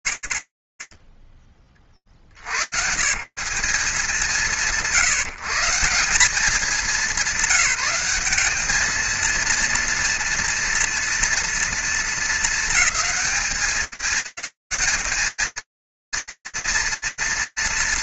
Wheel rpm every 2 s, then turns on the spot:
80, 160, 170, 190, 220, 230, 210, 200, 230.
none